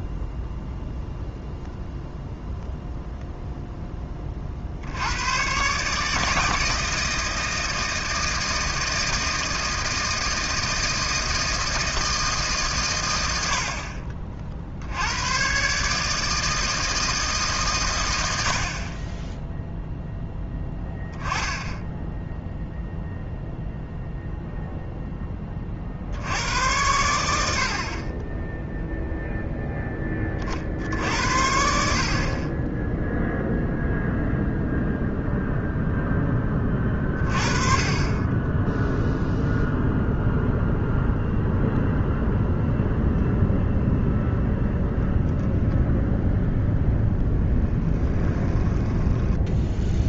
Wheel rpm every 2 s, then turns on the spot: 0, 0, 80, 160, 160, 160, 130, 70, 160, 50, 10, 0, 0, 100, 0, 60, 10, 0, 20, 10, 0, 0, 0, 10, 20.
46-50